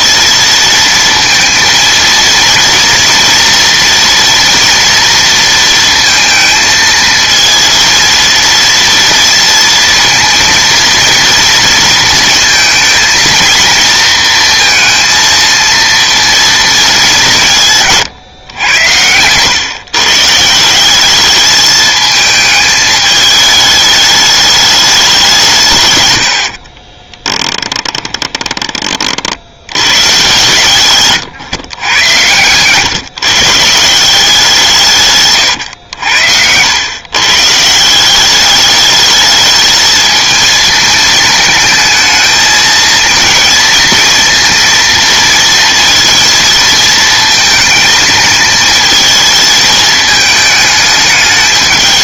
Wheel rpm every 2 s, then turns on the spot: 230, 230, 230, 220, 230, 230, 230, 230, 220, 110, 160, 220, 210, 60, 30, 130, 130, 180, 100, 200, 220, 220, 230, 220, 220, 210.
26-28